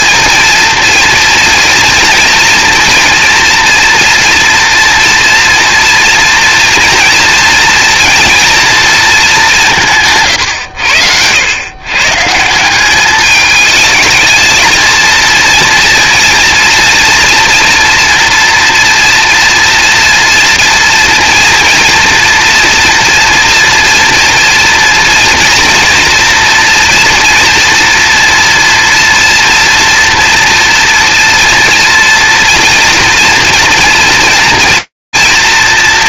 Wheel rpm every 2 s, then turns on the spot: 230, 230, 230, 230, 240, 120, 170, 220, 230, 240, 240, 230, 230, 230, 240, 240, 230, 230.
none